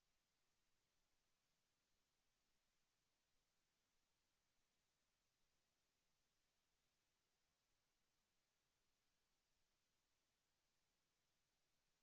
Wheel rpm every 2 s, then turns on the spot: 0, 0, 0, 0, 0, 0.
none